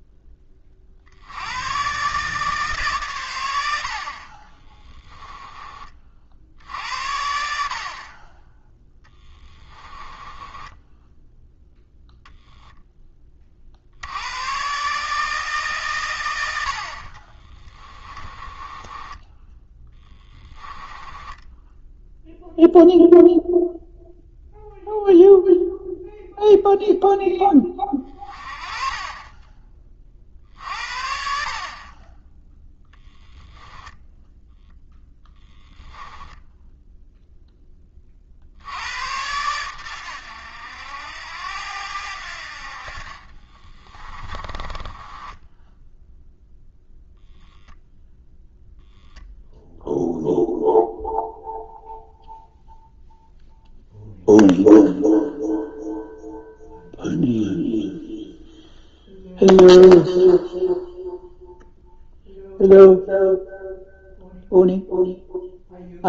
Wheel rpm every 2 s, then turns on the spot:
40, 130, 20, 70, 10, 10, 10, 130, 80, 20, 10, 0, 0, 0, 30, 60, 0, 0, 0, 80, 80, 50, 20, 0, 0, 0, 0, 0, 0, 0, 0, 0, 0.
4-6 10-12 18-22 44-46